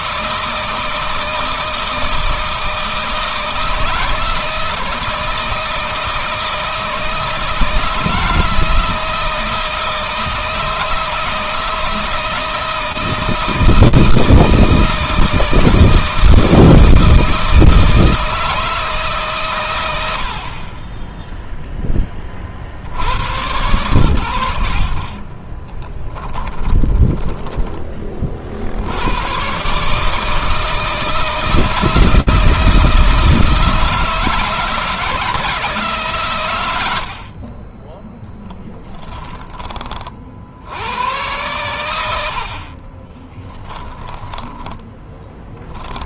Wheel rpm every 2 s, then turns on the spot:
160, 160, 160, 160, 160, 160, 160, 160, 160, 150, 20, 70, 60, 10, 90, 160, 160, 160, 80, 10, 100, 40, 20.
26-28 38-40 42-46